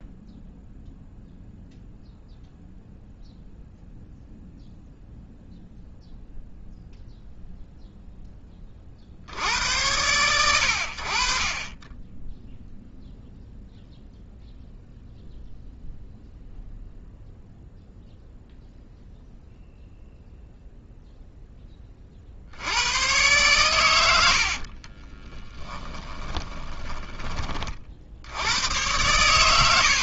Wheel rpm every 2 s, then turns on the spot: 0, 0, 0, 0, 20, 90, 0, 0, 0, 0, 0, 80, 50, 20, 100.
24-28